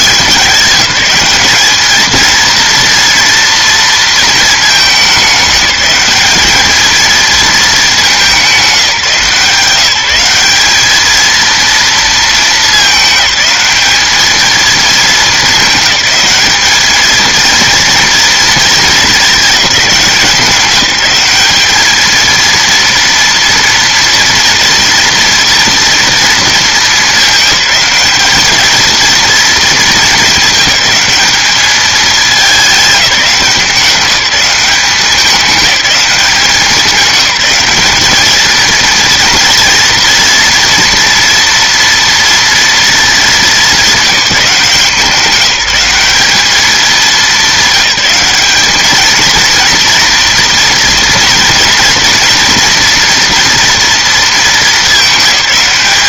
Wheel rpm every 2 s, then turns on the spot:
190, 230, 210, 210, 190, 210, 210, 220, 210, 220, 190, 230, 230, 220, 220, 210, 200, 190, 190, 230, 230, 230, 180, 210, 210, 230, 240, 210.
none